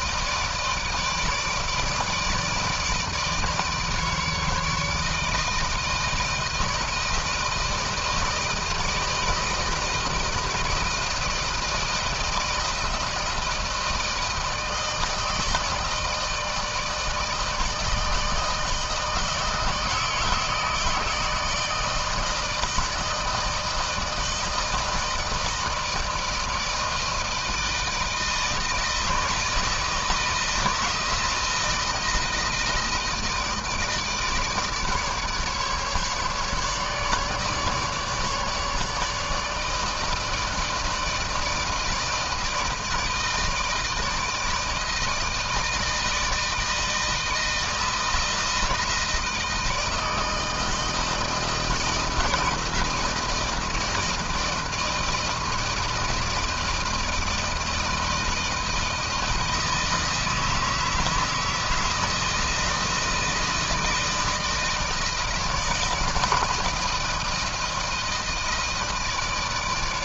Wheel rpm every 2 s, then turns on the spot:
160, 160, 160, 160, 160, 160, 160, 160, 160, 160, 160, 160, 160, 160, 160, 160, 160, 150, 150, 150, 160, 160, 160, 160, 160, 160, 160, 160, 160, 160, 160, 160, 160, 160, 160.
none